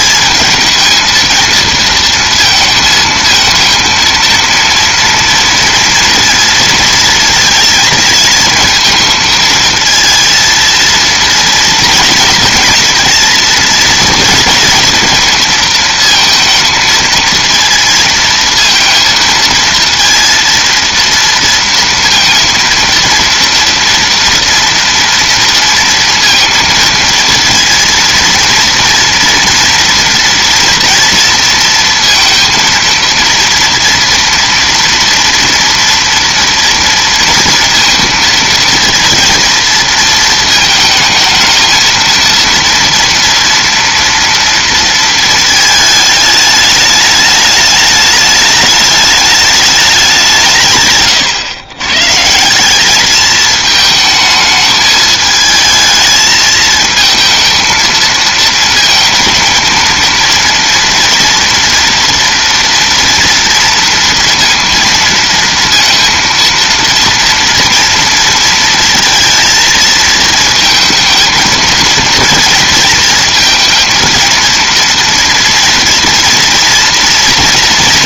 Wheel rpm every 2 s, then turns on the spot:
210, 230, 230, 230, 230, 230, 230, 230, 230, 230, 230, 230, 230, 230, 230, 230, 230, 230, 230, 230, 230, 230, 230, 210, 210, 160, 180, 220, 220, 220, 230, 230, 230, 230, 230, 220, 230, 230, 240.
none